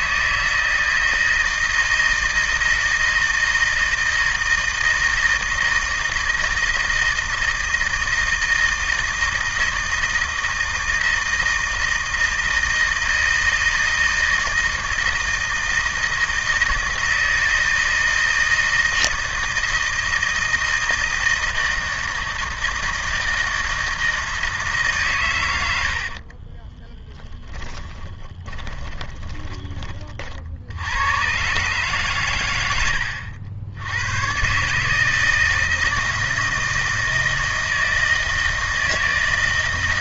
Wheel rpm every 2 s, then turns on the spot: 160, 160, 160, 160, 160, 160, 160, 160, 160, 160, 160, 160, 150, 20, 20, 80, 90, 150, 160, 160.
26-30